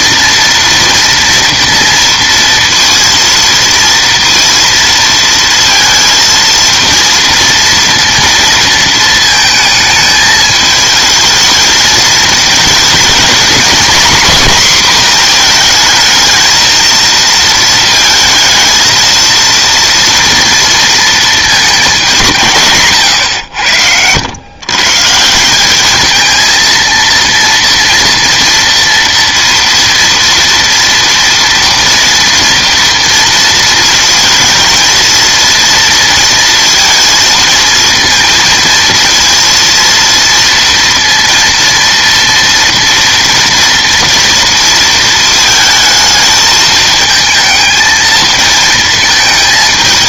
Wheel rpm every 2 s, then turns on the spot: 230, 230, 230, 230, 230, 220, 220, 250, 220, 220, 230, 150, 130, 230, 230, 230, 230, 220, 230, 230, 230, 230, 230, 220, 220.
none